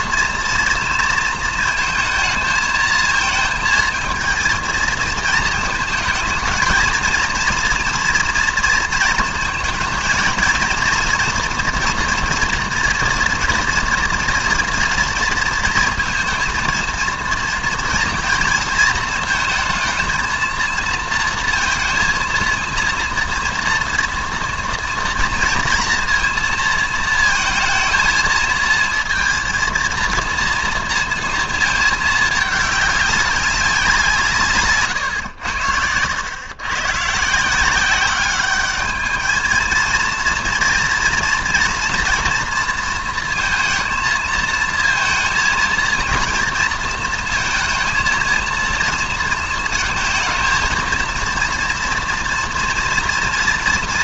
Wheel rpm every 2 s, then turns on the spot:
230, 220, 230, 220, 230, 230, 230, 230, 230, 230, 230, 230, 230, 230, 220, 230, 210, 140, 120, 210, 230, 230, 230, 230, 230, 230, 230.
none